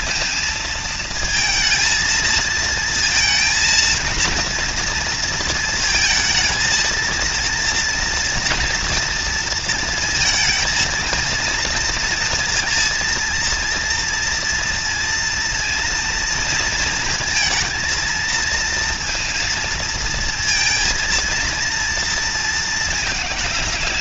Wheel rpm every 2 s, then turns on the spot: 230, 230, 230, 230, 230, 230, 230, 230, 230, 230, 230, 210.
none